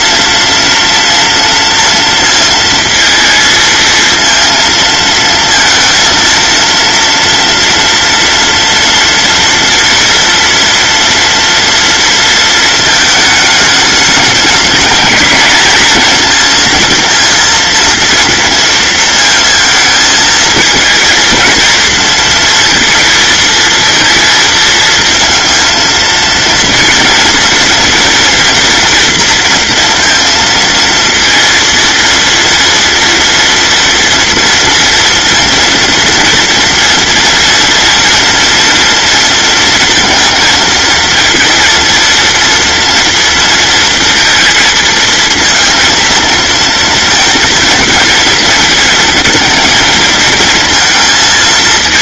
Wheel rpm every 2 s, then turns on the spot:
230, 230, 230, 230, 230, 230, 220, 220, 230, 230, 220, 230, 230, 230, 240, 230, 230, 230, 230, 230, 230, 230, 230, 230, 230, 230.
none